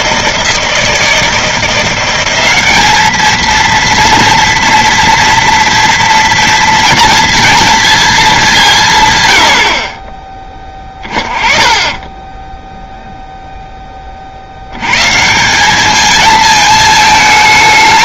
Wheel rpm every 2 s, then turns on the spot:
160, 200, 230, 230, 170, 20, 0, 90, 220.
none